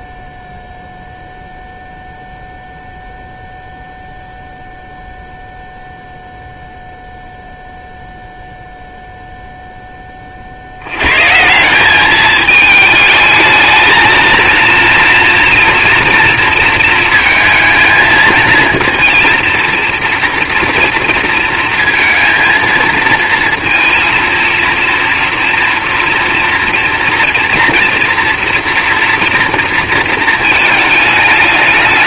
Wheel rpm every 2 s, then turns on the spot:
0, 0, 0, 0, 0, 50, 210, 230, 230, 230, 230, 220, 230, 230, 230, 220.
none